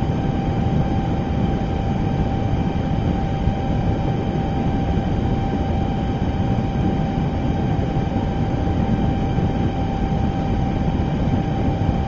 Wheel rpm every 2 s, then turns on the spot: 0, 0, 0, 0, 0, 0.
none